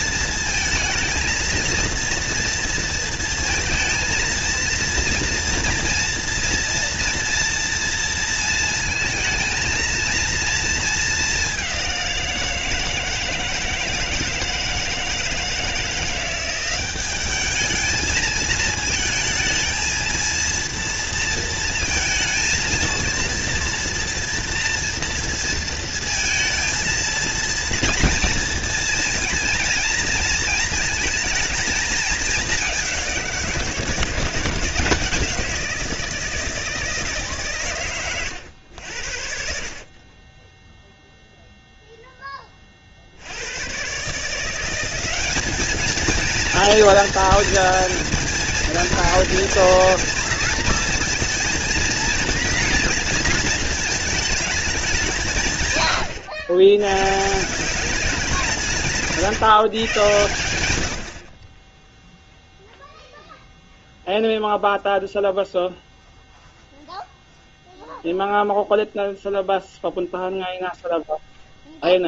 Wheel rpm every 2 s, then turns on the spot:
230, 230, 230, 230, 220, 220, 160, 160, 190, 220, 230, 230, 230, 230, 230, 220, 200, 170, 160, 80, 10, 30, 180, 230, 230, 230, 230, 190, 110, 170, 80, 0, 0, 0, 0, 0.
58-60